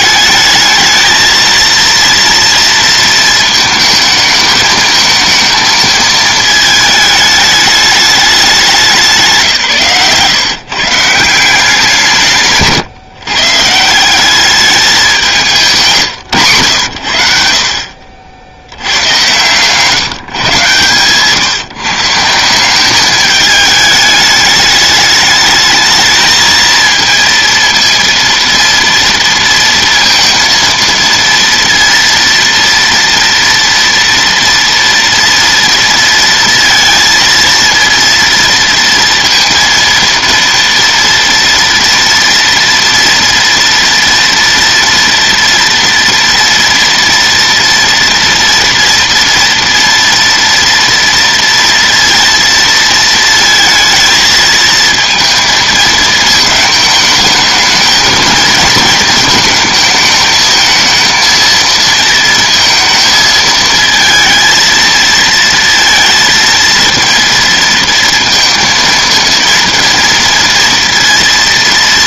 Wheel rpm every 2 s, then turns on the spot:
220, 230, 220, 220, 180, 150, 150, 200, 90, 100, 130, 200, 210, 220, 230, 230, 230, 230, 230, 230, 230, 240, 230, 230, 230, 230, 230, 220, 220, 230, 220, 220, 230, 230, 230, 230.
none